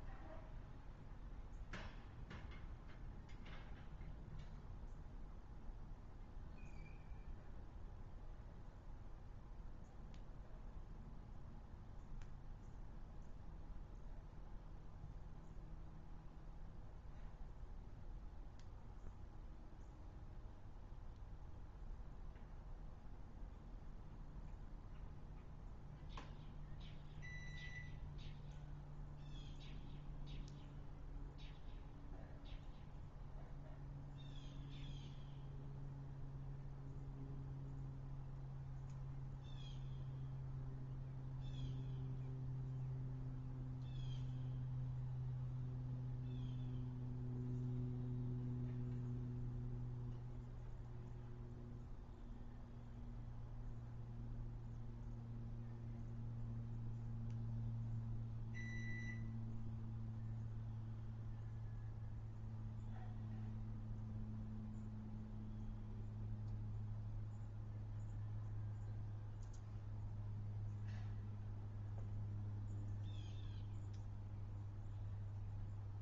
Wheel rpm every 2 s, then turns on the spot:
0, 0, 0, 0, 0, 0, 0, 0, 0, 0, 0, 0, 0, 0, 0, 0, 0, 0, 0, 0, 0, 0, 0, 0, 0, 0, 0, 0, 0, 0, 0, 0, 0, 0, 0, 0, 0, 0.
none